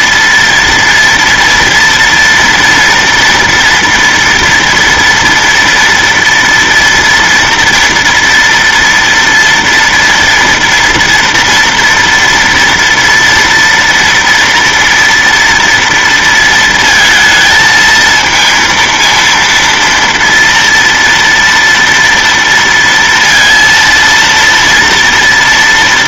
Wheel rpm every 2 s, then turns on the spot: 240, 230, 230, 230, 230, 230, 230, 230, 230, 230, 230, 230, 230.
none